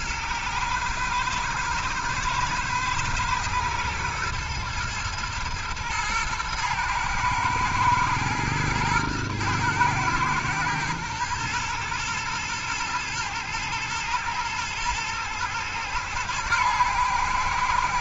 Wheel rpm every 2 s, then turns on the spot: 110, 110, 120, 120, 110, 110, 120, 110, 110.
none